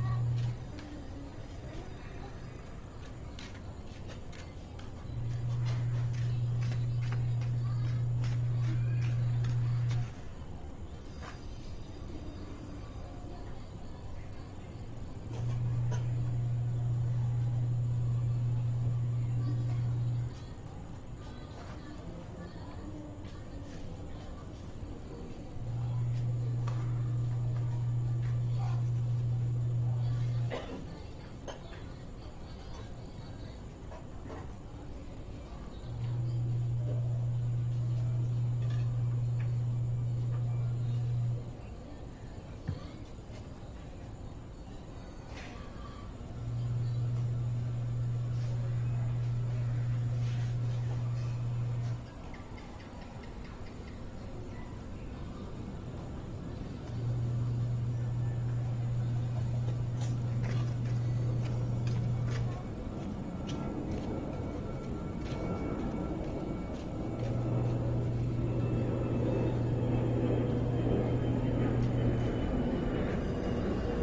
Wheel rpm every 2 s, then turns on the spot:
0, 0, 0, 0, 0, 0, 0, 0, 0, 0, 0, 0, 0, 0, 0, 0, 0, 0, 0, 0, 0, 0, 0, 0, 0, 0, 0, 0, 0, 0, 0, 0, 0, 0, 0, 0, 0.
none